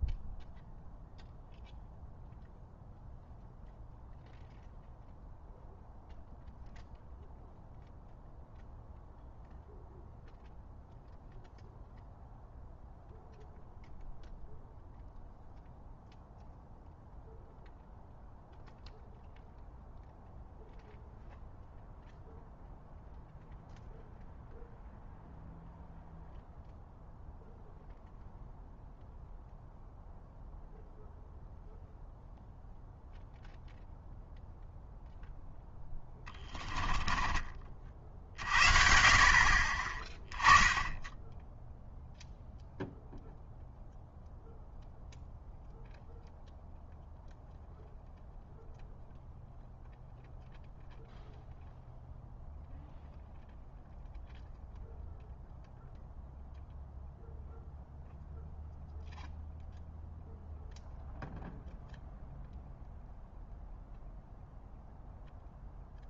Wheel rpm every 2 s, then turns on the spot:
0, 0, 0, 0, 0, 0, 0, 0, 0, 0, 0, 0, 0, 0, 0, 0, 0, 0, 20, 50, 10, 0, 0, 0, 0, 0, 0, 0, 0, 0, 0, 0, 0.
36-38